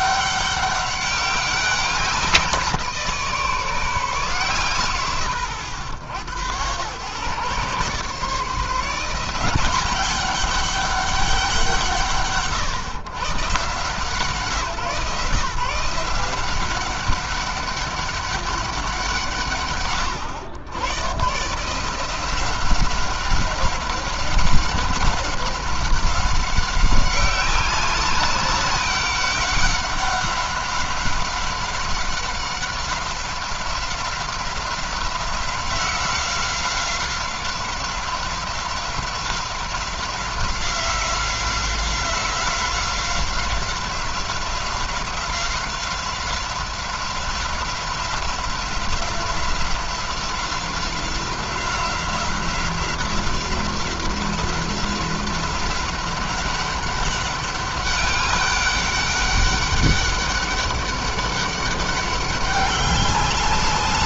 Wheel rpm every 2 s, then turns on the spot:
200, 170, 120, 110, 160, 200, 140, 160, 190, 180, 110, 190, 190, 190, 200, 190, 190, 180, 180, 180, 180, 180, 190, 180, 180, 180, 180, 190, 190, 200, 200, 200.
none